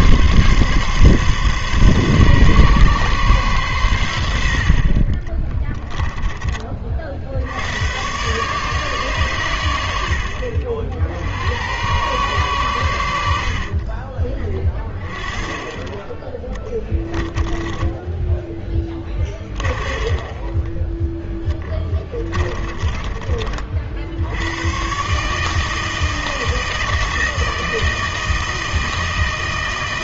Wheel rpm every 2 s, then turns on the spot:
140, 140, 60, 30, 150, 60, 110, 20, 10, 10, 20, 20, 110, 160, 160.
18-24